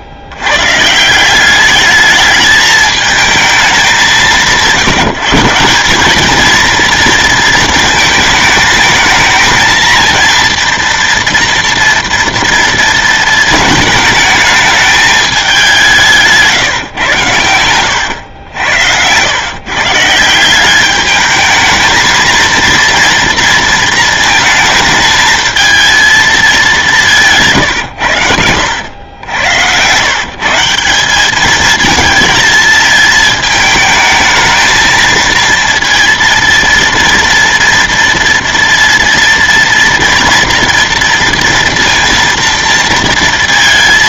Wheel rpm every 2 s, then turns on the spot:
130, 220, 180, 230, 220, 230, 230, 220, 130, 90, 200, 230, 230, 200, 90, 180, 220, 220, 230, 230, 230, 230.
none